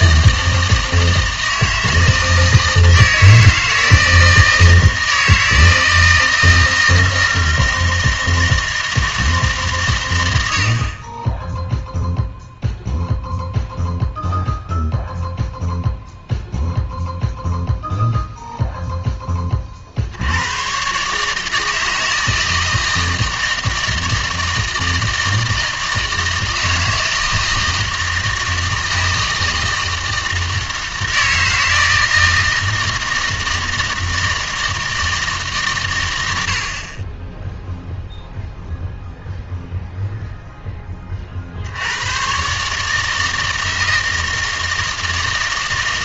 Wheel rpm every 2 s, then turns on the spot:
160, 160, 160, 160, 160, 80, 0, 0, 0, 0, 120, 160, 160, 160, 160, 160, 160, 160, 60, 0, 10, 140, 160.
none